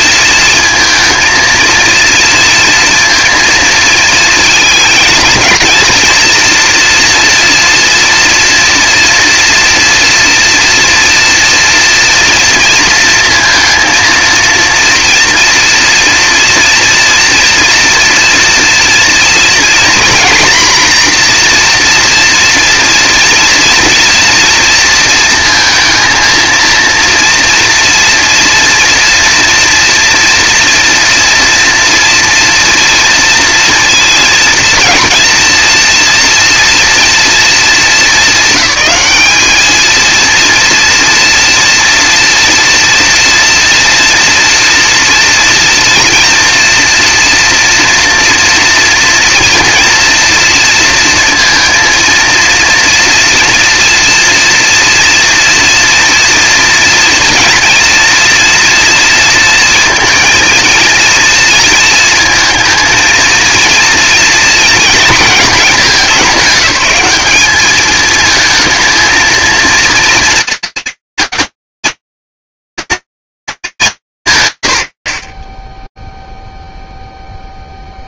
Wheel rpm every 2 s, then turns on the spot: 230, 230, 230, 240, 230, 230, 230, 230, 230, 230, 240, 230, 230, 230, 230, 240, 230, 230, 230, 200, 230, 230, 230, 230, 230, 230, 230, 230, 230, 230, 230, 230, 230, 200, 230, 230, 220, 100, 0.
none